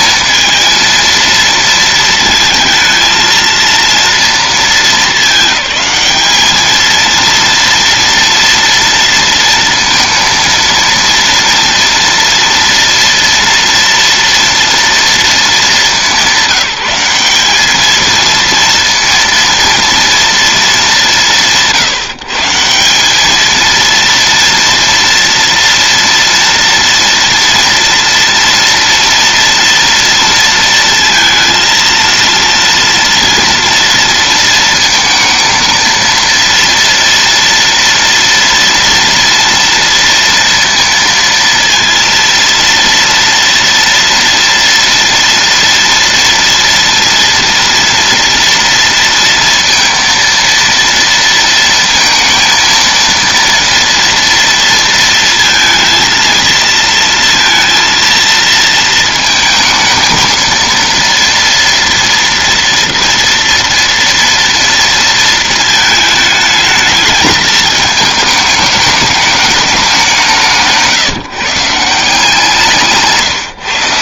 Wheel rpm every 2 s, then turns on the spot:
230, 230, 220, 220, 230, 230, 240, 230, 200, 230, 210, 170, 230, 240, 230, 230, 230, 230, 230, 230, 230, 230, 230, 230, 230, 230, 230, 230, 230, 230, 230, 230, 230, 210, 210, 160, 160.
none